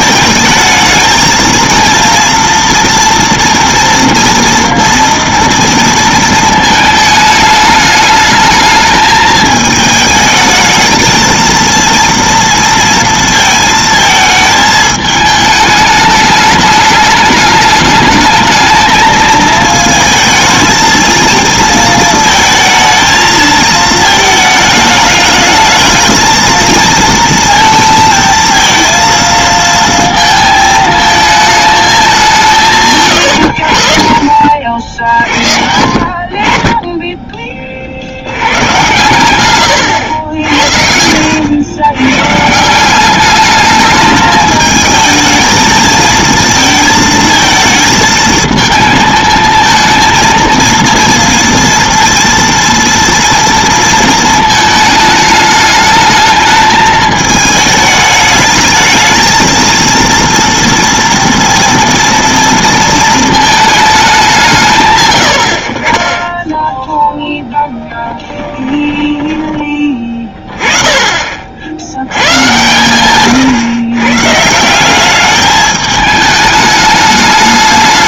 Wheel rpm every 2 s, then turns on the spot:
220, 230, 230, 220, 220, 220, 230, 220, 210, 220, 220, 220, 220, 230, 230, 220, 150, 60, 20, 110, 70, 170, 220, 220, 220, 230, 230, 220, 220, 220, 230, 230, 150, 10, 20, 20, 120, 180, 210.
40-42 68-70